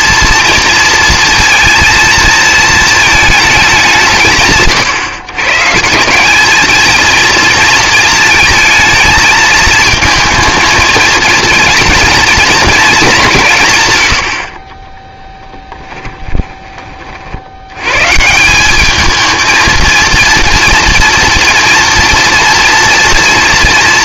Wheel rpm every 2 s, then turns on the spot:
230, 230, 140, 220, 230, 220, 230, 40, 20, 190, 230, 230.
none